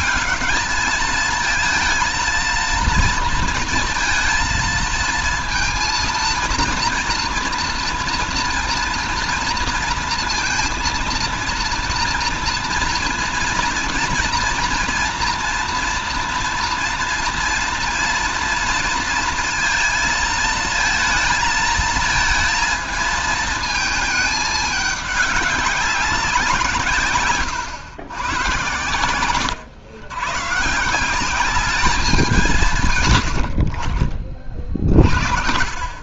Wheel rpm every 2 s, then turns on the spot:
210, 230, 230, 230, 230, 230, 230, 230, 230, 230, 220, 230, 210, 180, 120, 150, 160, 40.
none